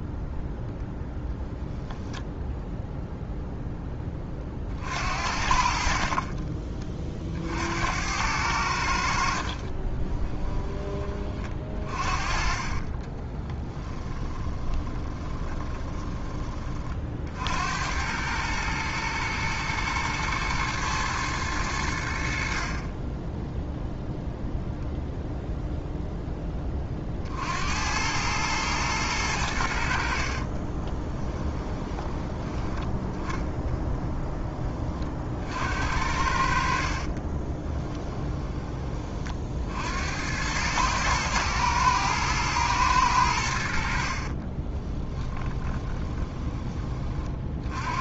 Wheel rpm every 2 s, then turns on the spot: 0, 0, 60, 40, 70, 20, 20, 20, 40, 110, 110, 30, 0, 40, 110, 20, 10, 30, 40, 30, 110, 110, 20, 30.
12-16 22-24 30-32 36-38 44-46